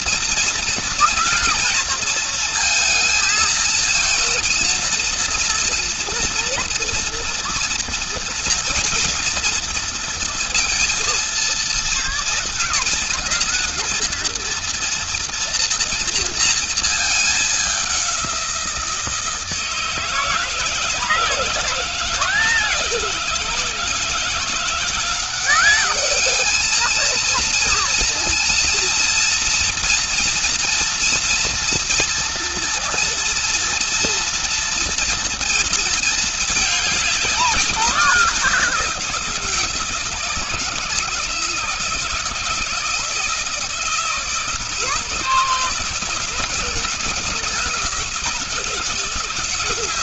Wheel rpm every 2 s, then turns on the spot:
230, 230, 230, 230, 230, 230, 230, 240, 220, 170, 160, 160, 170, 220, 230, 230, 230, 230, 210, 180, 160, 170, 160, 160, 160.
none